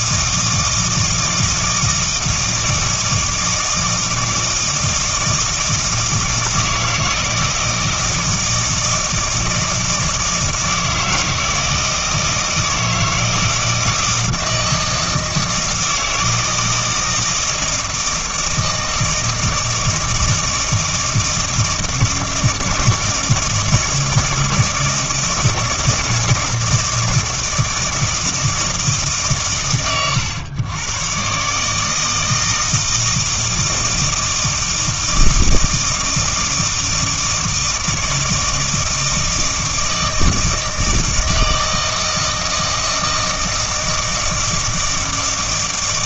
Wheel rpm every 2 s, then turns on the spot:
160, 160, 160, 160, 160, 160, 160, 160, 160, 160, 160, 160, 160, 160, 130, 110, 160, 160, 160, 160, 160, 160, 160.
none